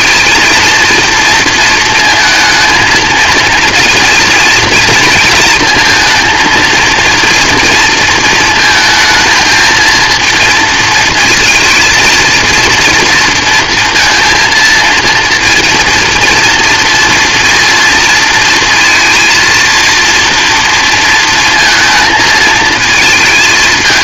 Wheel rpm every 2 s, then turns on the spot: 230, 220, 230, 230, 220, 230, 230, 230, 230, 230, 230, 220.
none